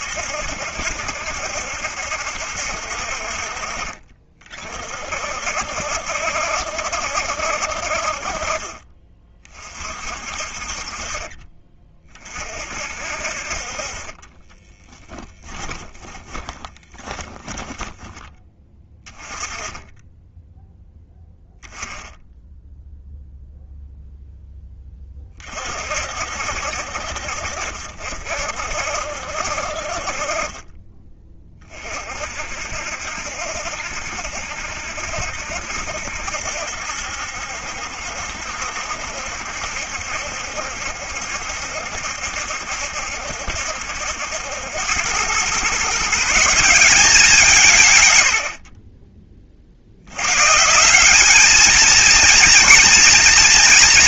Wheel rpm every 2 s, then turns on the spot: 60, 70, 40, 70, 40, 40, 40, 20, 20, 20, 10, 10, 10, 60, 60, 30, 60, 70, 70, 70, 70, 70, 80, 170, 70, 150, 230.
14-18 48-50